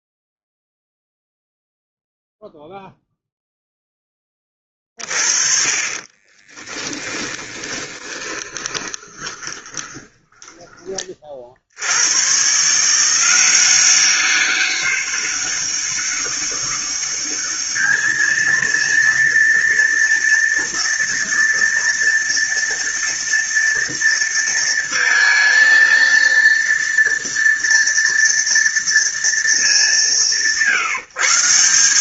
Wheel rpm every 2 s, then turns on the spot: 0, 0, 20, 30, 20, 10, 110, 190, 200, 220, 230, 230, 230, 230, 230, 170.
6-12